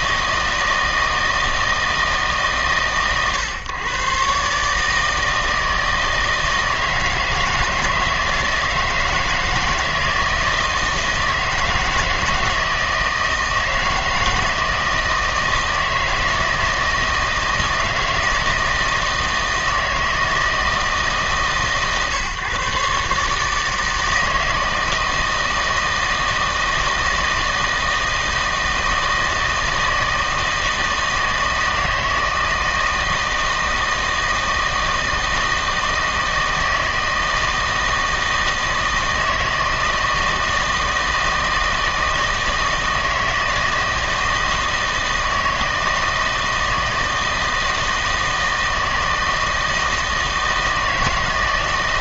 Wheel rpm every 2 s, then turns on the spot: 160, 140, 150, 160, 160, 160, 160, 160, 160, 160, 160, 130, 160, 160, 160, 160, 160, 160, 160, 160, 160, 160, 160, 160, 160, 160.
none